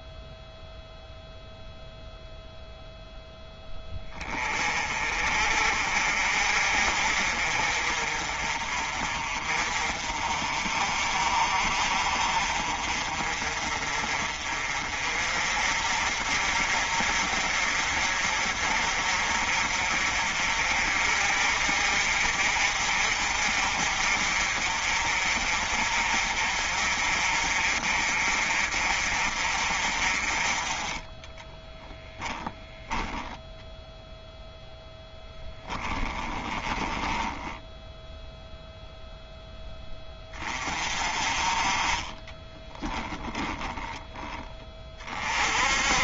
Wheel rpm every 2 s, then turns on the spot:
0, 0, 40, 50, 40, 40, 40, 40, 50, 50, 50, 50, 50, 50, 50, 30, 10, 0, 10, 0, 30, 10, 30.
36-38 42-44